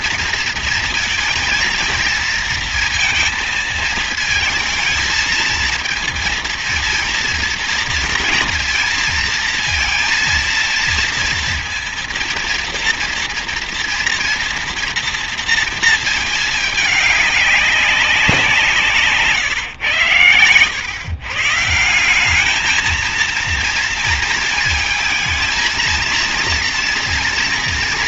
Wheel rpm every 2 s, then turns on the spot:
230, 230, 230, 230, 230, 230, 230, 230, 220, 170, 120, 210, 230, 230.
none